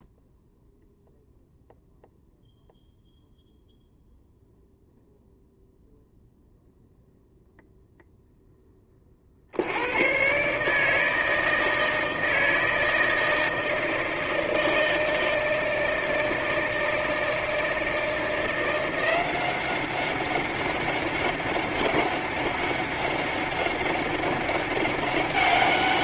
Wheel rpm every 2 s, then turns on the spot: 0, 0, 0, 0, 20, 150, 160, 160, 160, 170, 190, 200, 200.
none